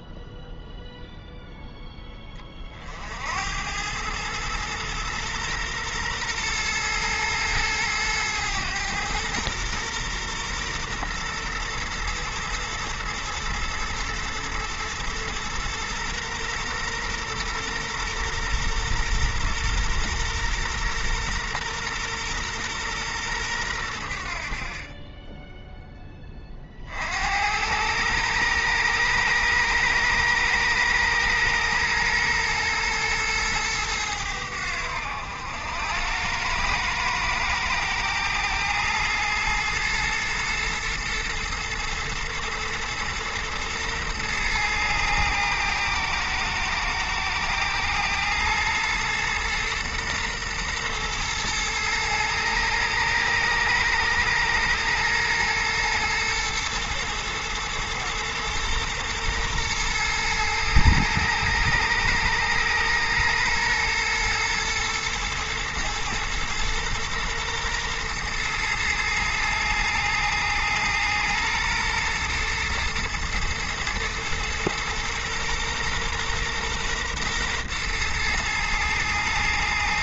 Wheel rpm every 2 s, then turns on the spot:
0, 30, 110, 120, 110, 120, 110, 120, 120, 120, 120, 120, 50, 30, 110, 110, 120, 90, 110, 110, 110, 110, 110, 110, 110, 120, 110, 110, 110, 120, 110, 110, 120, 120, 120, 110, 120, 120, 120, 120.
none